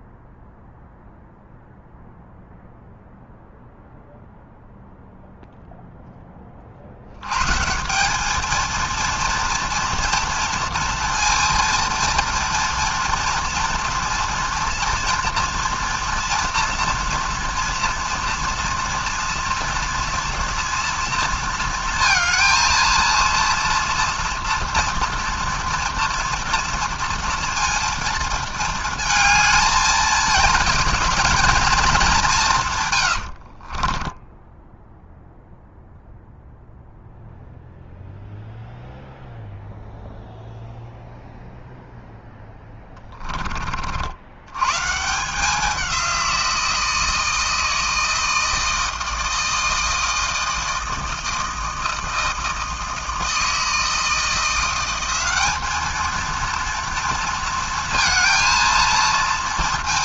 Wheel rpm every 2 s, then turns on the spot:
0, 0, 0, 30, 220, 230, 230, 230, 230, 230, 230, 230, 230, 230, 220, 220, 160, 10, 0, 0, 0, 0, 100, 170, 160, 160, 160, 170, 230, 230.
34-36